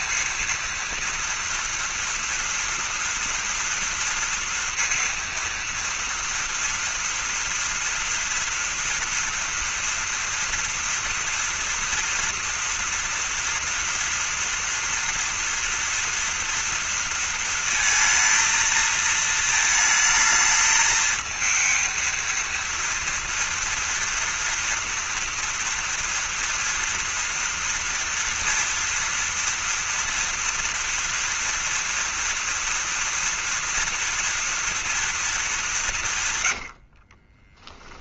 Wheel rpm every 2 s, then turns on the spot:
230, 230, 230, 230, 230, 240, 230, 230, 240, 220, 220, 230, 230, 240, 230, 230, 240, 240, 100.
36-38